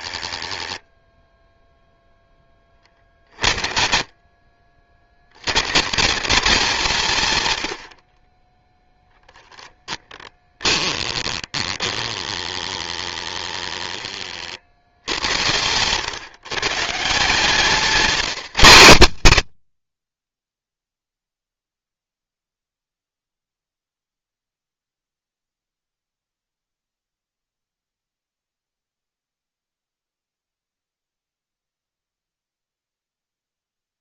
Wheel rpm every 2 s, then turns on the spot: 0, 40, 70, 190, 10, 20, 10, 60, 140, 150, 0, 0, 0, 0, 0, 0, 0.
8-14